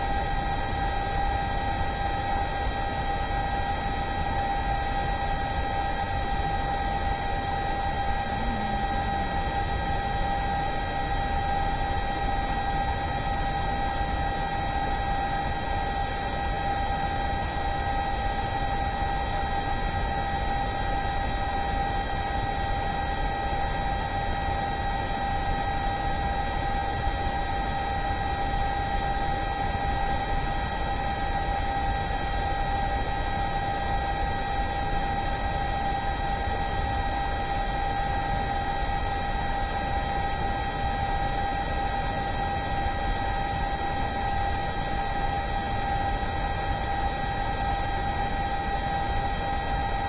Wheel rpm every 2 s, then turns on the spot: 0, 0, 0, 0, 0, 0, 0, 0, 0, 0, 0, 0, 0, 0, 0, 0, 0, 0, 0, 0, 0, 0, 0, 0, 0.
none